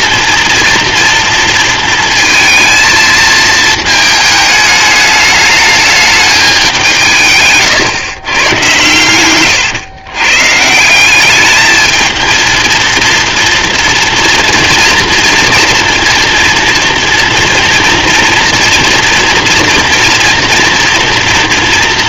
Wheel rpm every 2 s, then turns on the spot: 230, 220, 210, 150, 110, 180, 230, 230, 230, 230, 230.
8-10